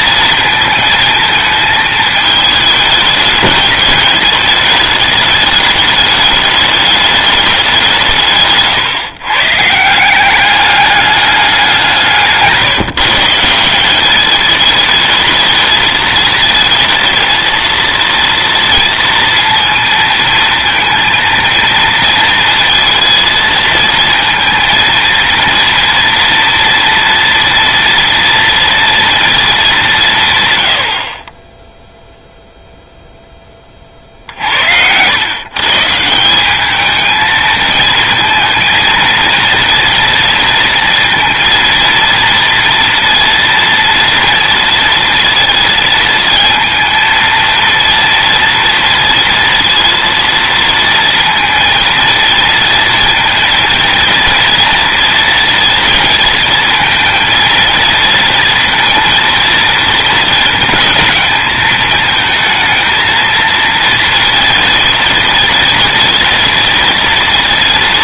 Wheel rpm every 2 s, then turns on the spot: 230, 210, 220, 210, 140, 200, 160, 220, 230, 230, 230, 230, 230, 230, 230, 90, 0, 80, 210, 230, 230, 230, 230, 230, 230, 230, 230, 230, 230, 230, 220, 230, 230, 230.
none